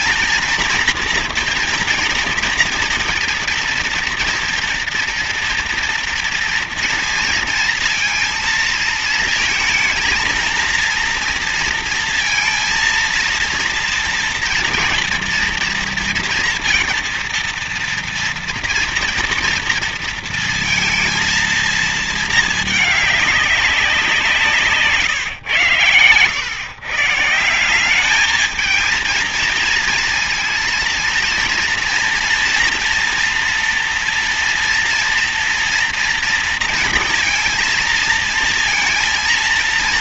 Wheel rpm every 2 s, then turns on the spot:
230, 240, 240, 230, 230, 230, 230, 230, 230, 230, 230, 220, 160, 120, 220, 230, 230, 240, 230, 230.
none